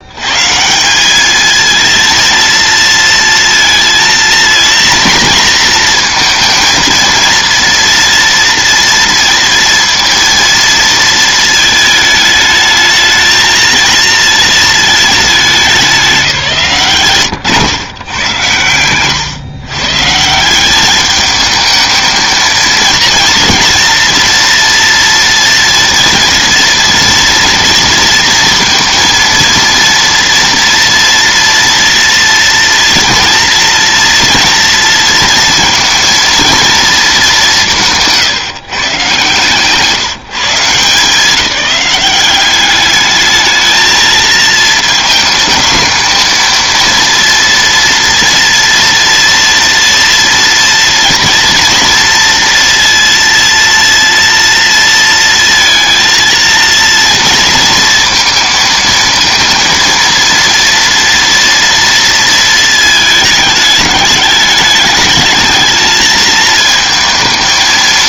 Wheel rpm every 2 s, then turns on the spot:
170, 230, 230, 230, 230, 230, 220, 220, 150, 110, 190, 230, 230, 230, 230, 230, 230, 230, 230, 150, 180, 210, 230, 230, 240, 230, 230, 230, 230, 220, 230, 220, 210, 220.
none